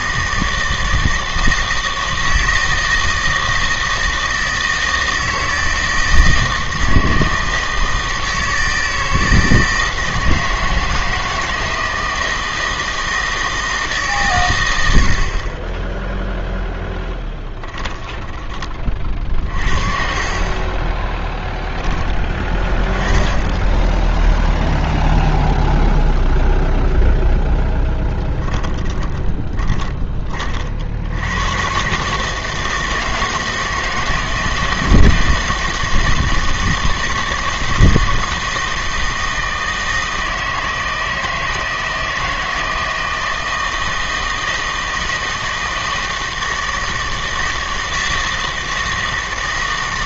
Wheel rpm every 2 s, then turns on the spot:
160, 160, 160, 160, 160, 160, 160, 110, 0, 30, 30, 10, 0, 0, 10, 40, 160, 160, 160, 160, 160, 160, 160, 160, 160.
20-22 28-30